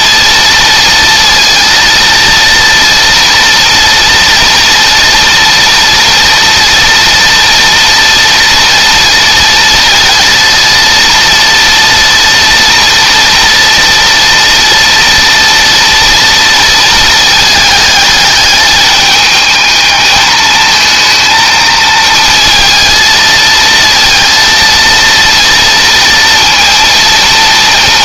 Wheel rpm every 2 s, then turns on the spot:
230, 230, 240, 230, 230, 230, 230, 230, 230, 210, 220, 220, 230, 230.
none